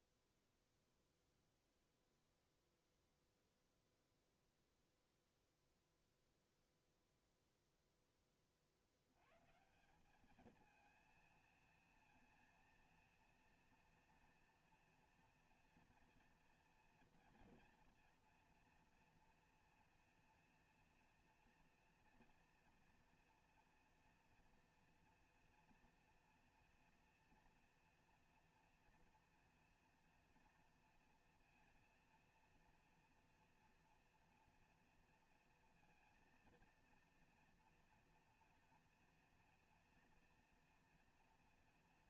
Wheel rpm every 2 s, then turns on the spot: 0, 0, 0, 0, 90, 230, 230, 240, 230, 230, 240, 240, 230, 230, 230, 230, 230, 230, 230, 230, 230.
none